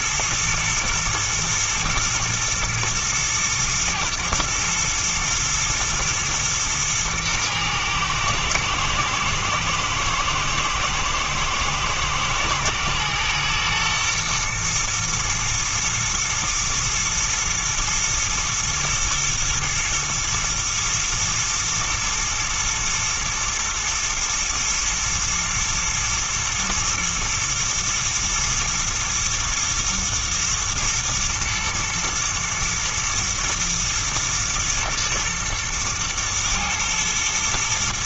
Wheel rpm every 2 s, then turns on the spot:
110, 110, 110, 110, 110, 110, 120, 120, 110, 120, 110, 110, 110, 120, 120, 120, 120, 110, 110.
none